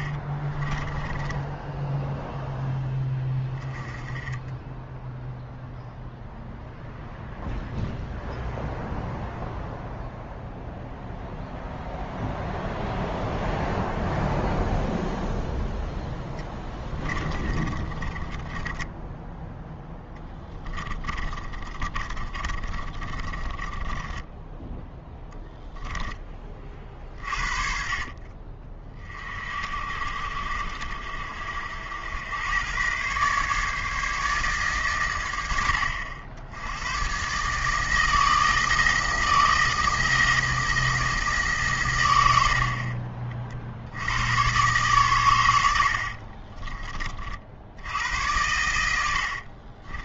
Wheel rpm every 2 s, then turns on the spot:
30, 10, 10, 0, 0, 0, 0, 0, 20, 10, 10, 30, 10, 40, 30, 50, 110, 130, 100, 170, 160, 60, 120, 40, 90.
0-2 16-26 46-48